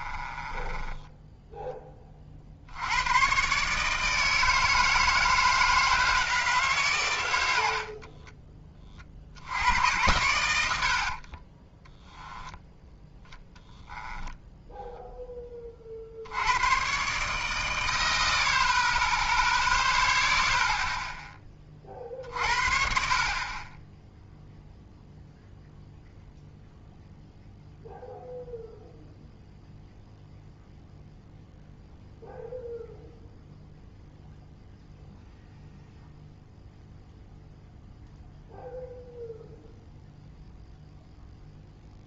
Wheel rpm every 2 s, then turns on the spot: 20, 80, 160, 140, 20, 80, 10, 0, 100, 30, 0, 50, 0, 0, 0, 0, 0, 0, 0, 0, 0.
0-2